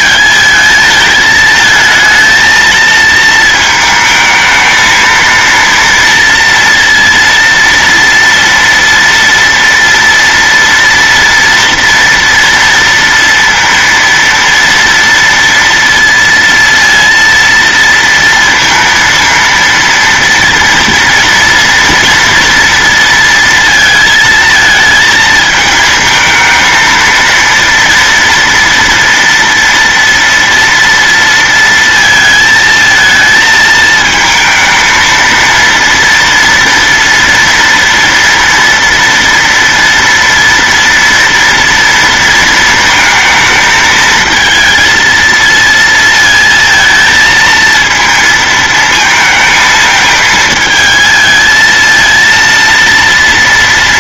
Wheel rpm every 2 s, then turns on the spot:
220, 220, 220, 230, 230, 230, 230, 230, 230, 230, 230, 230, 220, 230, 230, 230, 220, 230, 230, 230, 230, 220, 230, 230, 220, 220, 230.
none